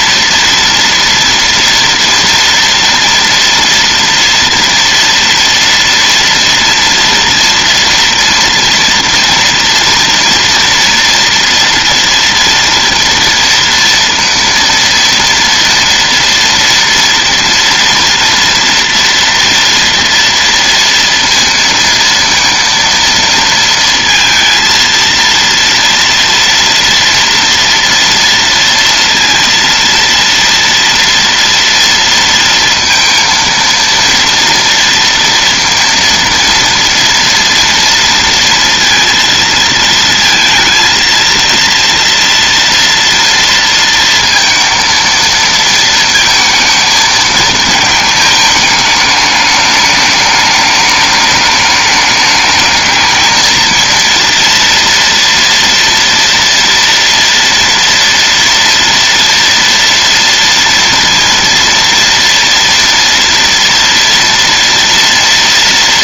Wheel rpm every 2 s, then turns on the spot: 230, 230, 240, 230, 230, 230, 230, 230, 230, 230, 230, 230, 230, 230, 230, 230, 230, 230, 230, 230, 220, 230, 230, 220, 210, 210, 220, 230, 230, 230, 230, 230, 230.
none